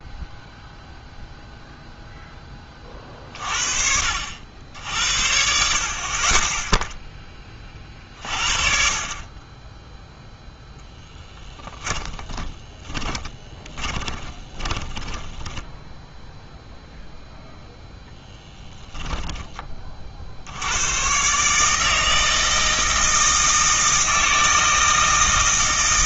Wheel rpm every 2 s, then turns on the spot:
0, 30, 70, 10, 50, 0, 10, 20, 0, 10, 100, 160, 160.
12-16 18-20